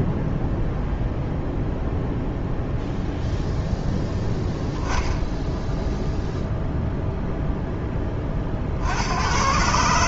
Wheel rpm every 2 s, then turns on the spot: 0, 0, 0, 0, 50.
none